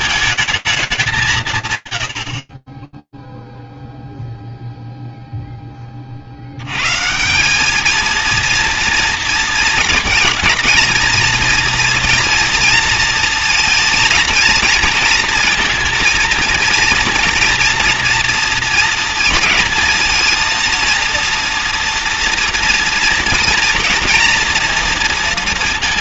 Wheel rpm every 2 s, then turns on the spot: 220, 30, 0, 120, 230, 230, 230, 230, 230, 230, 230, 230, 230.
none